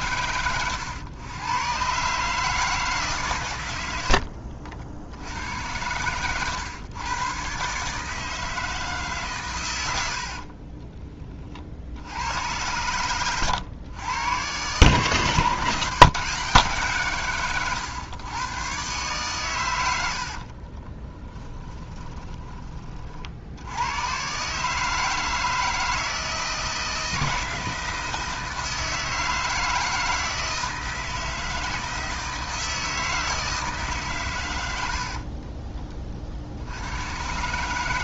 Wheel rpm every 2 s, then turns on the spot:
100, 150, 60, 110, 150, 30, 100, 130, 150, 120, 20, 30, 150, 160, 160, 160, 160, 80, 80.
10-12 20-22 34-36